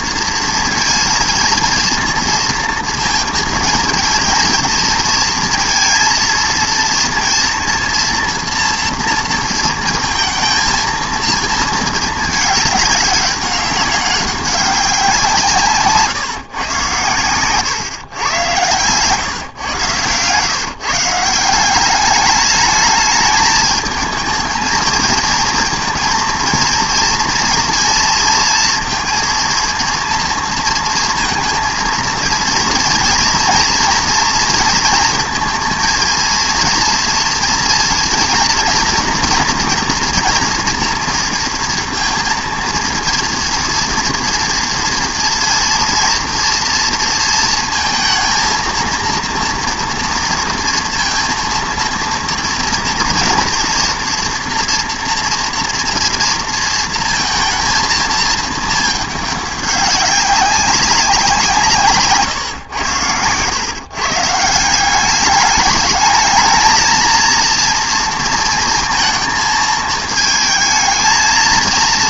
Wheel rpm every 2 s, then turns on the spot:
230, 230, 220, 230, 230, 220, 210, 200, 130, 110, 140, 210, 220, 230, 230, 230, 230, 230, 230, 230, 230, 230, 230, 240, 230, 230, 230, 240, 230, 220, 190, 120, 170, 220, 230, 220.
none